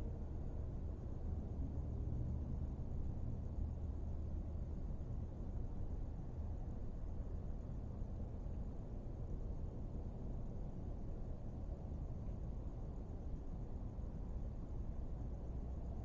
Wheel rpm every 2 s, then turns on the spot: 0, 0, 0, 0, 0, 0, 0, 0.
none